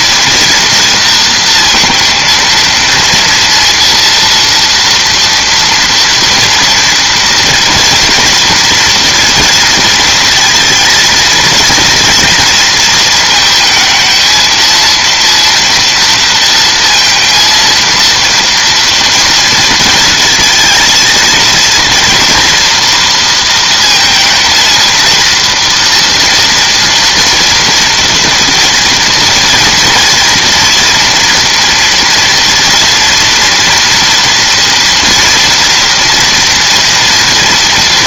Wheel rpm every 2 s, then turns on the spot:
230, 230, 230, 240, 230, 230, 230, 220, 230, 230, 230, 230, 230, 230, 230, 230, 230, 230, 240.
none